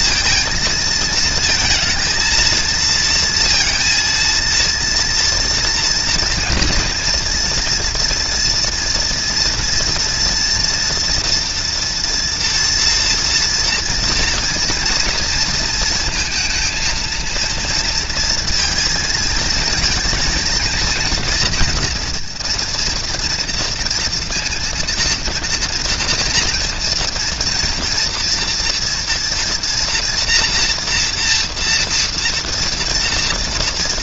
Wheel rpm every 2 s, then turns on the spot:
230, 230, 230, 230, 230, 240, 230, 230, 230, 230, 230, 230, 230, 230, 230, 240, 240.
none